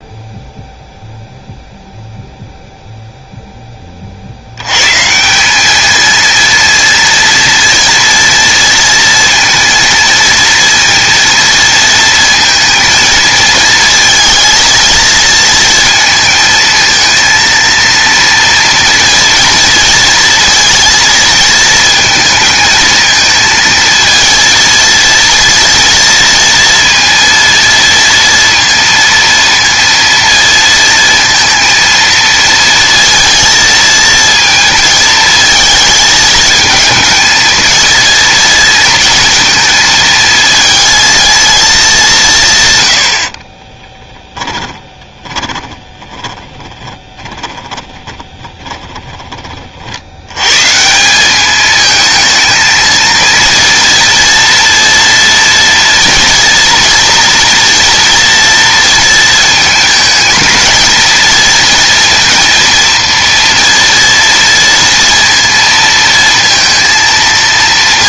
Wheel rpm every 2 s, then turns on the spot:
0, 0, 130, 230, 230, 230, 230, 230, 220, 230, 230, 220, 230, 230, 230, 230, 230, 230, 220, 230, 220, 100, 10, 20, 20, 160, 230, 230, 240, 230, 230, 230, 230, 230.
44-48